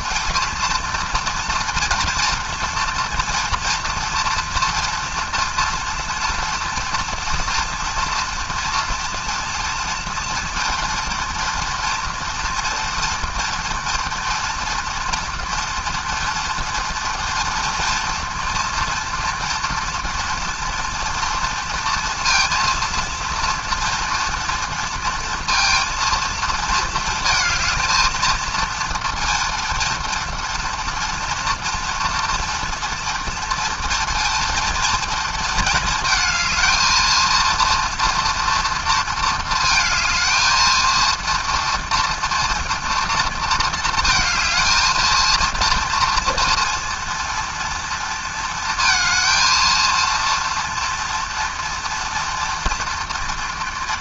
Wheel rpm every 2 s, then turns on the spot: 230, 230, 230, 230, 230, 230, 230, 240, 230, 230, 230, 230, 230, 220, 230, 230, 230, 230, 220, 230, 220, 230, 220, 230, 230, 230, 230.
none